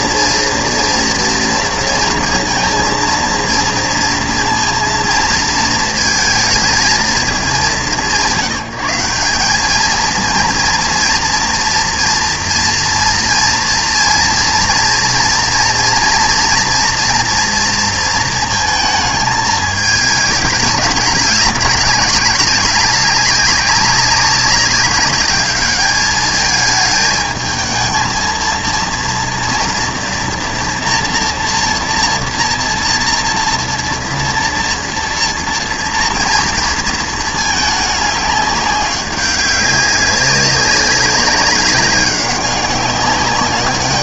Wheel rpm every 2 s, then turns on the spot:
230, 230, 230, 220, 180, 230, 230, 240, 230, 220, 210, 200, 200, 220, 230, 240, 230, 230, 220, 200, 200, 200.
none